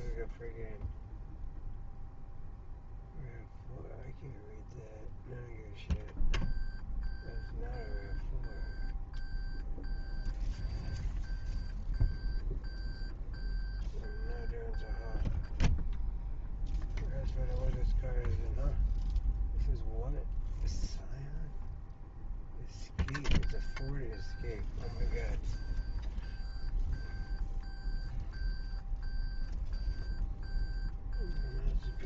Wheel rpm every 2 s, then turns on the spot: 0, 0, 0, 0, 0, 0, 0, 0, 0, 0, 0, 0, 0, 0, 0, 0.
none